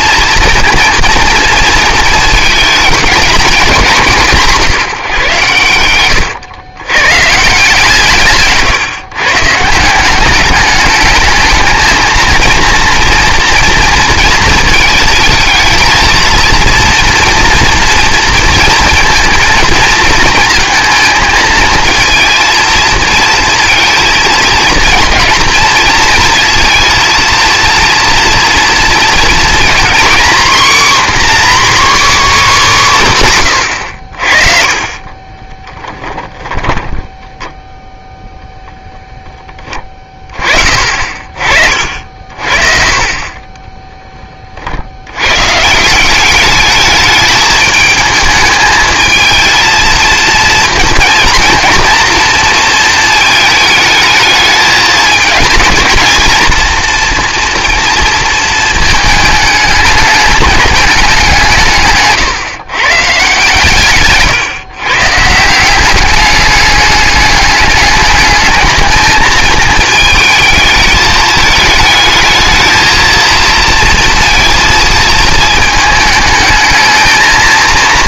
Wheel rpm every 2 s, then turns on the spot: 230, 210, 170, 100, 140, 210, 230, 220, 230, 230, 220, 230, 230, 230, 230, 260, 250, 40, 10, 0, 40, 40, 60, 210, 220, 230, 230, 220, 230, 220, 210, 130, 130, 210, 220, 220, 230, 230, 220.
34-38